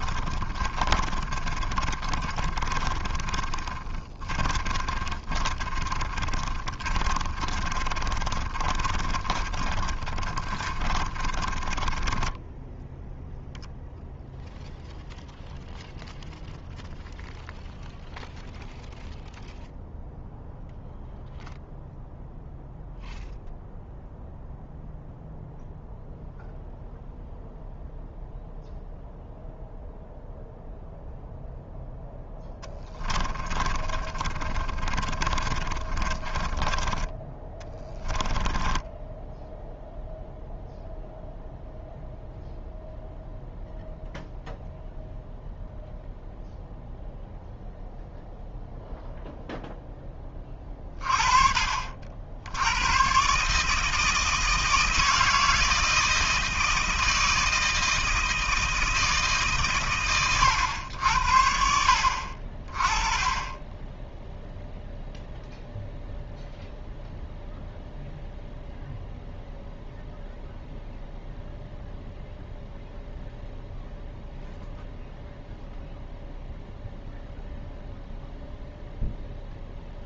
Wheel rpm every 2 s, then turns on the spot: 30, 30, 20, 40, 30, 40, 10, 0, 0, 0, 0, 0, 0, 0, 0, 0, 10, 30, 20, 10, 0, 0, 0, 0, 0, 30, 100, 160, 160, 160, 90, 30, 0, 0, 0, 0, 0, 0, 0, 0.
0-14 32-40